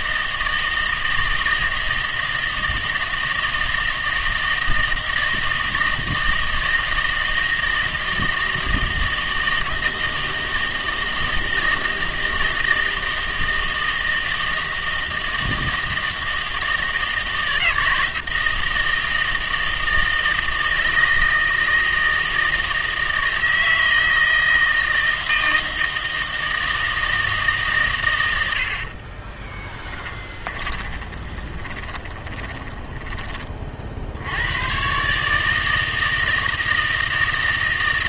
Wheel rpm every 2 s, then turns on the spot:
160, 160, 160, 160, 160, 160, 160, 160, 160, 160, 160, 160, 160, 160, 60, 30, 20, 110, 160.
30-34